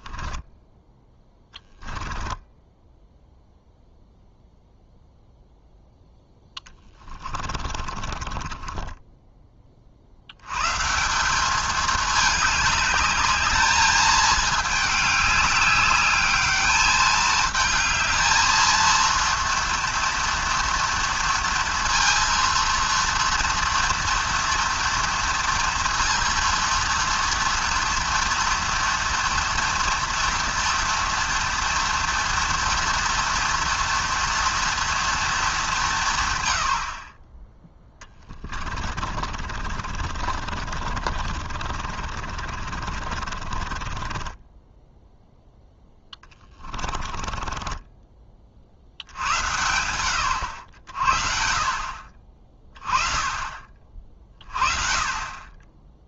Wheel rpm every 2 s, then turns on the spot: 10, 10, 0, 10, 20, 130, 210, 210, 210, 230, 230, 230, 230, 230, 230, 230, 230, 230, 80, 30, 50, 40, 10, 20, 50, 80, 30, 40.
0-4 6-10 38-48